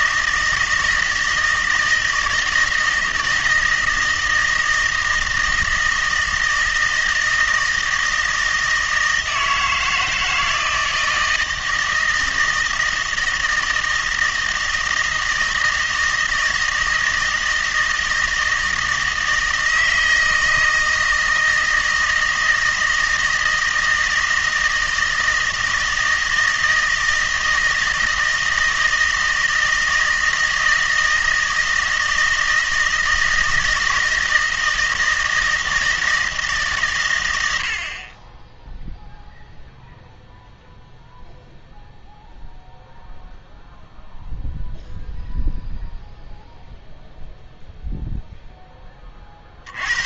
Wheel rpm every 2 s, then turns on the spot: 160, 160, 160, 160, 160, 160, 160, 160, 160, 160, 160, 160, 160, 160, 160, 160, 160, 160, 150, 10, 0, 0, 0, 0, 10.
none